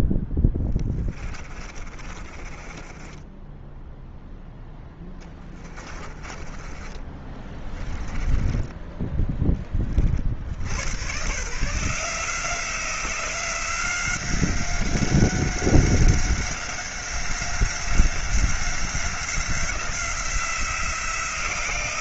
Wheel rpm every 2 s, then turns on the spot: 20, 20, 10, 20, 10, 90, 180, 190, 190, 180, 170.
0-8